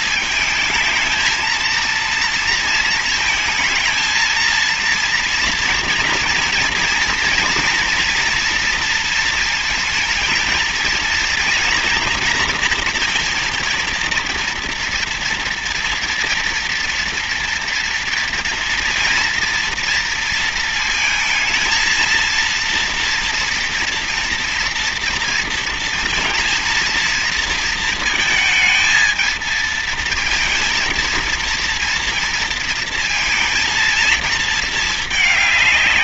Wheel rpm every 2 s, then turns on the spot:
220, 230, 230, 230, 230, 230, 240, 230, 230, 230, 230, 230, 230, 230, 230, 230, 230, 230.
none